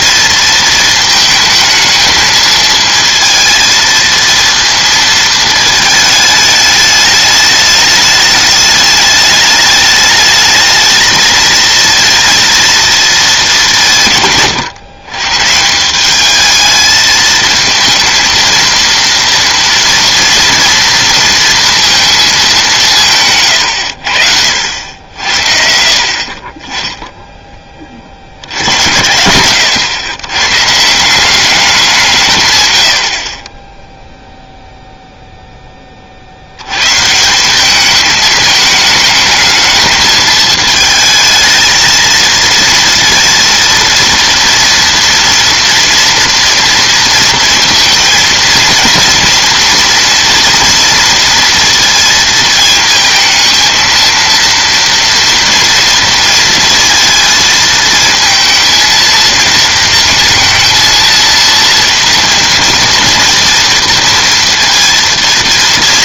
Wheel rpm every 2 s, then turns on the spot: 220, 220, 230, 210, 210, 220, 230, 130, 220, 230, 230, 200, 70, 20, 80, 140, 110, 0, 100, 220, 220, 230, 230, 230, 230, 230, 220, 230, 230, 230, 230, 230, 230.
none